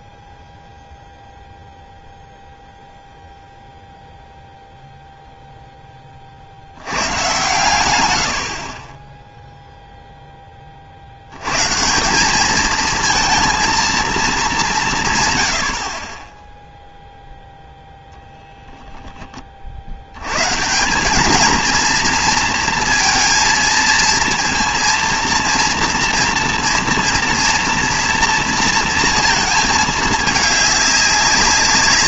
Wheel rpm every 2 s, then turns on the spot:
10, 0, 0, 80, 40, 70, 230, 130, 0, 10, 180, 230, 230, 230, 230, 200.
none